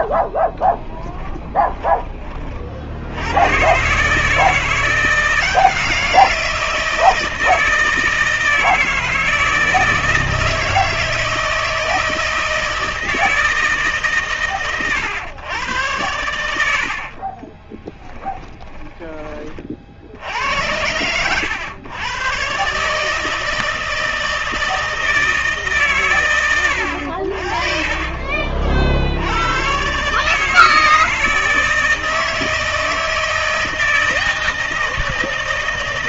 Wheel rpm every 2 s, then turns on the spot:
0, 50, 160, 170, 160, 160, 160, 120, 90, 10, 90, 140, 160, 100, 60, 150, 160, 160.
18-20